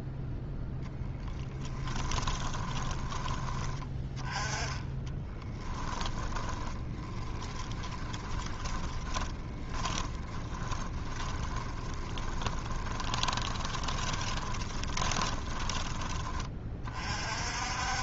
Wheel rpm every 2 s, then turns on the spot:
20, 10, 20, 20, 20, 20, 20, 20, 40.
0-2 4-16